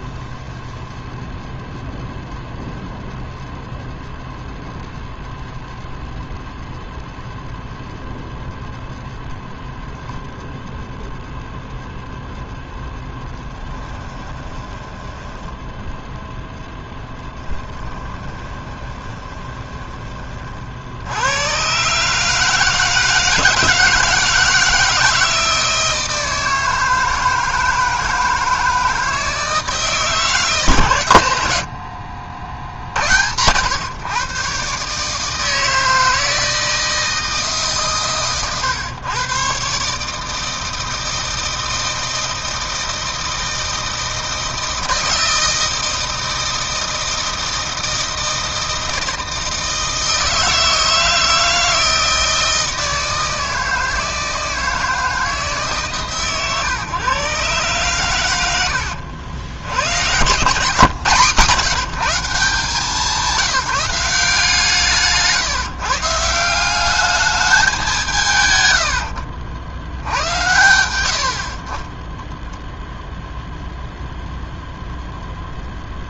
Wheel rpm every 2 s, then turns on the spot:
0, 0, 0, 0, 0, 0, 0, 20, 0, 20, 50, 160, 160, 160, 160, 140, 60, 130, 160, 120, 160, 160, 160, 160, 160, 160, 160, 160, 130, 80, 150, 150, 160, 190, 120, 90, 0, 0.
14-16 18-20 68-70